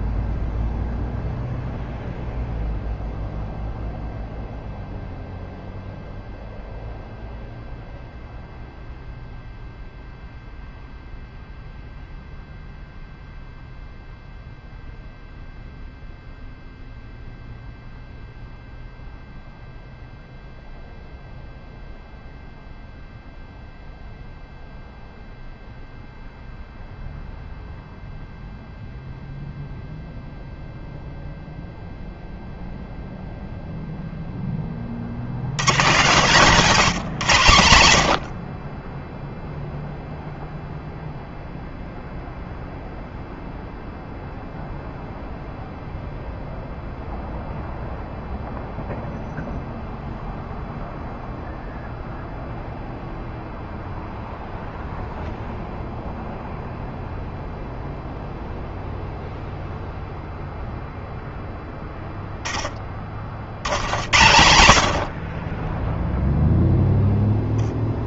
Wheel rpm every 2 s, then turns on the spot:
0, 0, 0, 0, 0, 0, 0, 0, 0, 0, 0, 0, 0, 0, 0, 0, 0, 10, 190, 60, 0, 0, 0, 0, 0, 0, 0, 0, 0, 0, 0, 10, 90, 0.
none